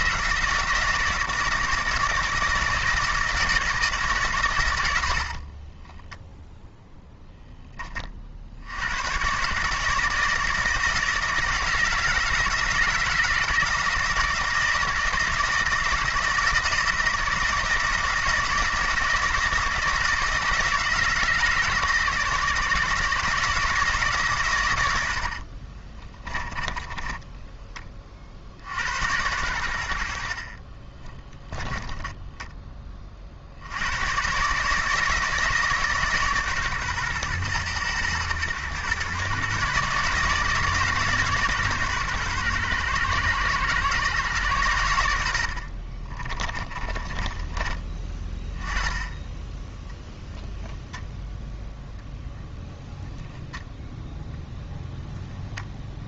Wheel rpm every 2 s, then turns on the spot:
170, 160, 110, 0, 70, 160, 160, 160, 160, 160, 160, 150, 120, 20, 70, 40, 20, 150, 140, 110, 150, 120, 110, 30, 10, 0, 0, 0.
26-28 30-32 46-48